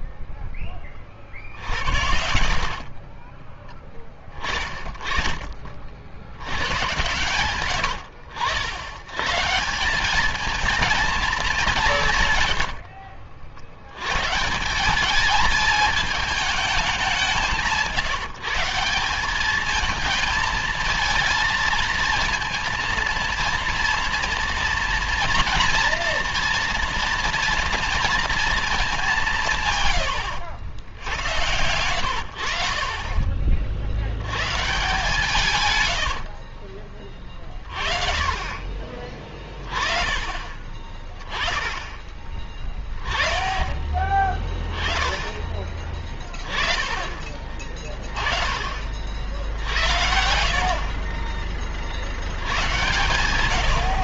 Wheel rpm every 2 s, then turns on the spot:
10, 50, 20, 100, 90, 220, 100, 170, 210, 170, 230, 230, 230, 230, 220, 90, 60, 120, 50, 30, 20, 20, 20, 20, 40, 60, 110.
2-8 12-14 32-34 36-38 42-44